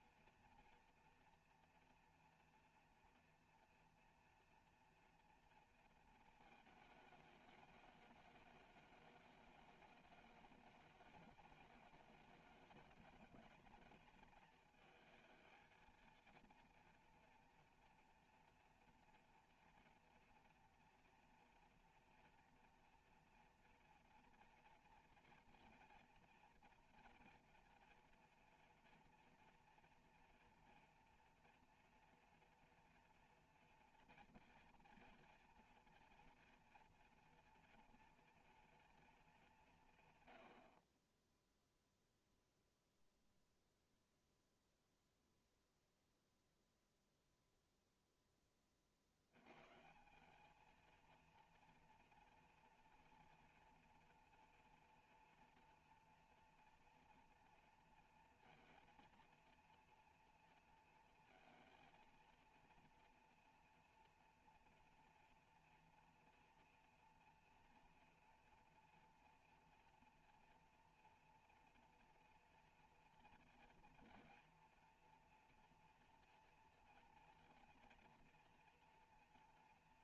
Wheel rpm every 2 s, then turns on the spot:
230, 230, 230, 210, 210, 210, 210, 220, 230, 230, 230, 230, 230, 230, 240, 230, 230, 230, 230, 230, 50, 0, 0, 0, 30, 220, 240, 240, 230, 230, 230, 230, 230, 240, 230, 240, 240, 240, 230, 230.
none